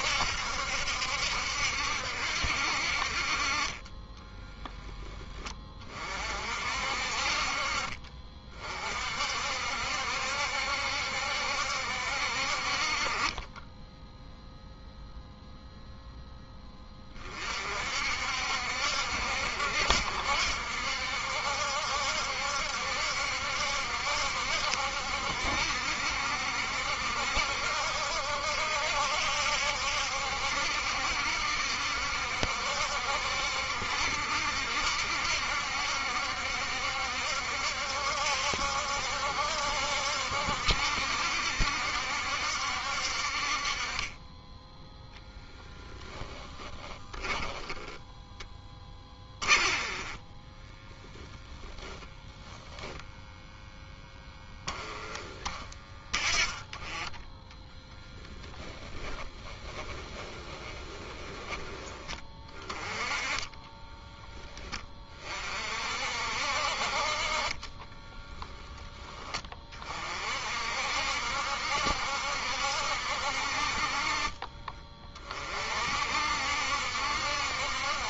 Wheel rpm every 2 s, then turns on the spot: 70, 60, 20, 50, 50, 70, 40, 0, 30, 70, 70, 70, 70, 70, 70, 70, 70, 70, 70, 70, 70, 70, 10, 10, 20, 10, 0, 10, 20, 30, 20, 20, 20, 50, 10, 60, 70, 30, 70.
46-50 58-64